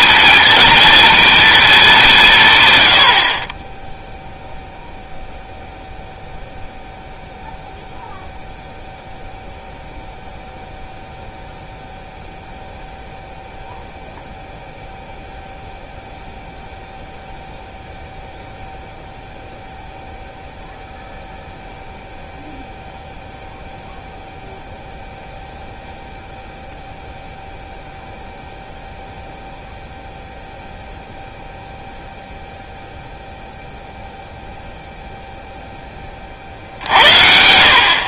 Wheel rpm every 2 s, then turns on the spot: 230, 100, 0, 0, 0, 0, 0, 0, 0, 0, 0, 0, 0, 0, 0, 0, 0, 0, 80.
none